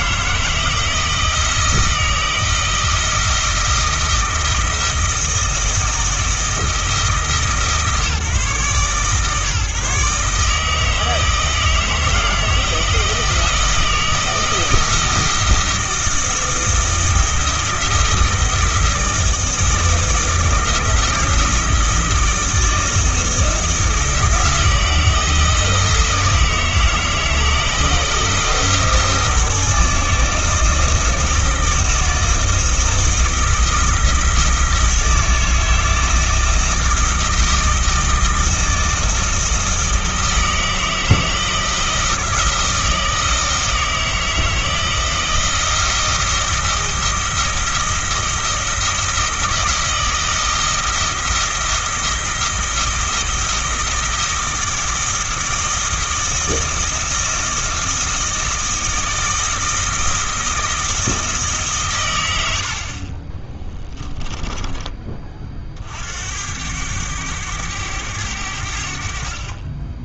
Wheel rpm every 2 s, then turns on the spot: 170, 160, 160, 160, 140, 160, 160, 160, 160, 160, 160, 160, 160, 160, 160, 160, 160, 160, 160, 160, 160, 160, 160, 160, 170, 160, 170, 160, 160, 160, 160, 60, 20, 100, 70.
62-64